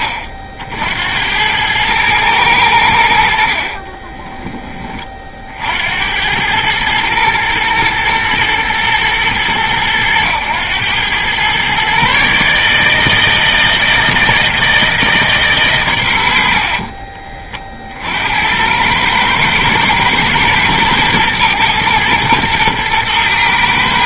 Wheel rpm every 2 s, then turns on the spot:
60, 90, 20, 110, 110, 100, 150, 160, 50, 90, 120, 110.
16-18